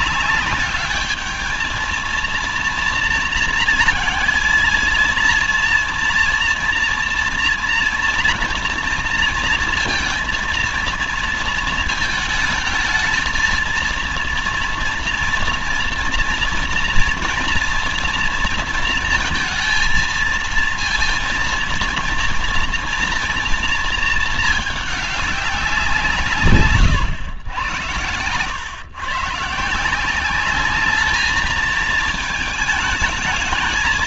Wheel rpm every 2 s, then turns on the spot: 210, 230, 230, 230, 230, 230, 220, 230, 230, 230, 230, 230, 210, 130, 120, 200, 220.
none